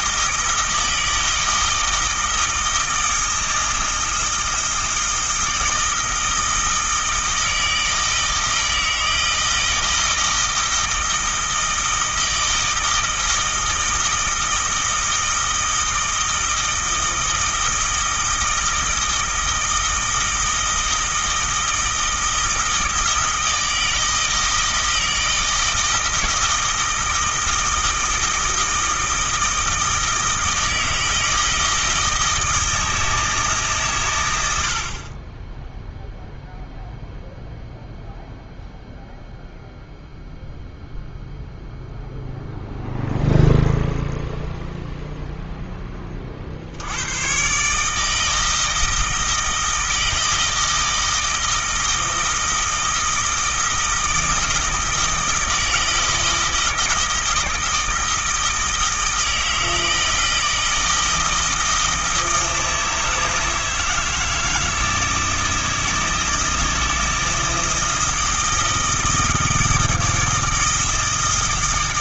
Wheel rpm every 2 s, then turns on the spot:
160, 160, 160, 160, 160, 160, 160, 160, 160, 160, 160, 160, 160, 160, 160, 160, 160, 40, 0, 0, 0, 0, 0, 80, 160, 160, 160, 160, 160, 160, 160, 160, 160, 160, 160, 160.
none